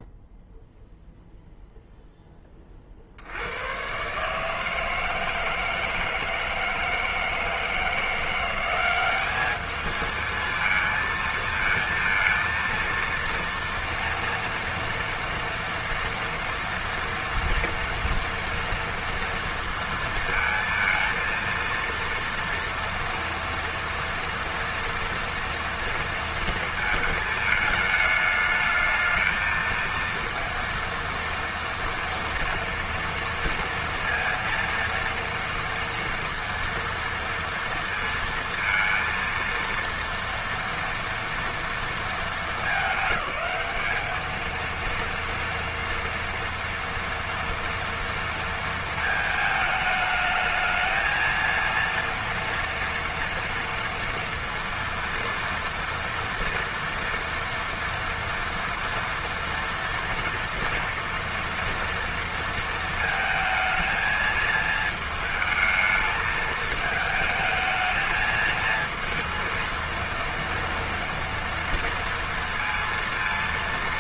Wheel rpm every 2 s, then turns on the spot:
0, 60, 160, 160, 190, 220, 230, 230, 230, 230, 230, 230, 230, 220, 220, 230, 230, 230, 230, 230, 230, 210, 230, 230, 220, 220, 230, 230, 230, 230, 230, 220, 220, 220, 230, 230, 230.
none